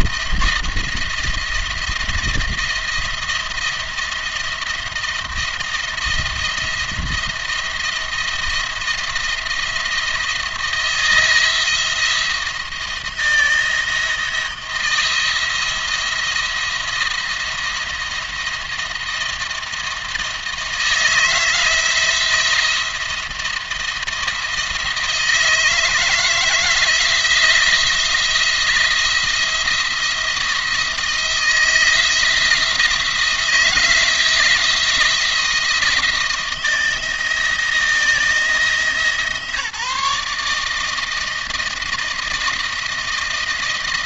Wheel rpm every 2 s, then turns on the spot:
170, 160, 170, 170, 170, 170, 170, 170, 170, 170, 160, 170, 170, 170, 170, 170, 170, 170, 170, 160, 160, 160.
none